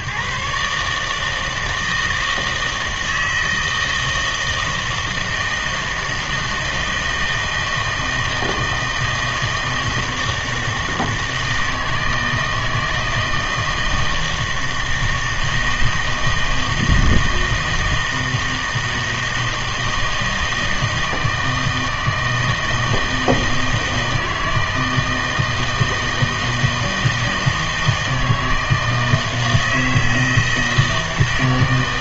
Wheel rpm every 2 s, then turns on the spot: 150, 160, 160, 160, 160, 160, 160, 160, 160, 160, 160, 160, 160, 160, 160, 160.
none